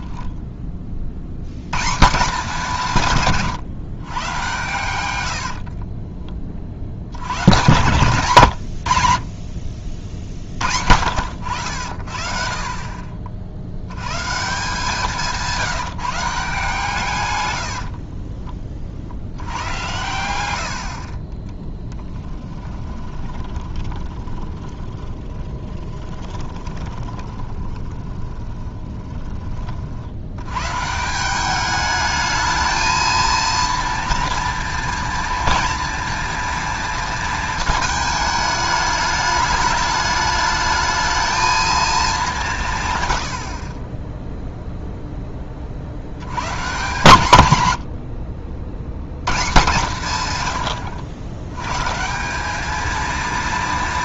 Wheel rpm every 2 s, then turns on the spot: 30, 180, 120, 40, 110, 50, 50, 160, 160, 30, 90, 10, 20, 20, 20, 120, 220, 230, 230, 210, 210, 160, 0, 140, 70, 100, 210.
20-30